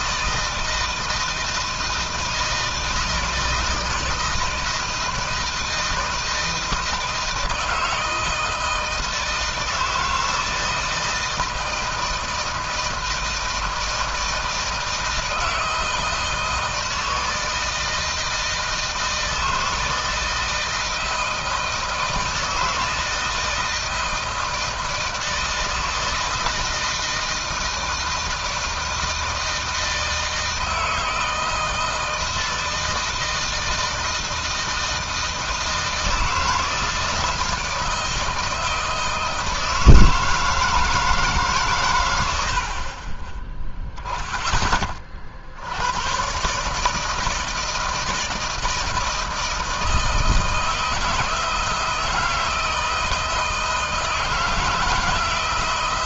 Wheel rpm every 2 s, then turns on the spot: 160, 160, 160, 160, 160, 160, 160, 160, 160, 160, 160, 160, 160, 160, 160, 160, 160, 160, 160, 160, 160, 40, 30, 150, 160, 160, 160, 160.
none